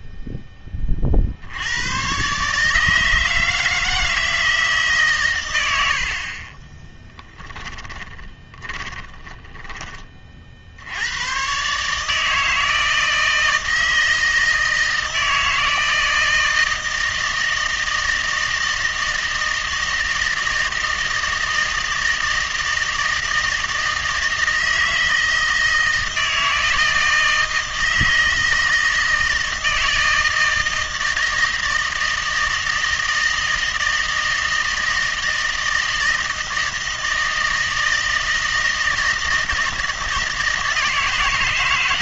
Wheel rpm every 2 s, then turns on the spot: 20, 150, 150, 30, 20, 60, 160, 160, 160, 160, 160, 160, 160, 160, 160, 160, 160, 160, 160, 160, 160.
8-10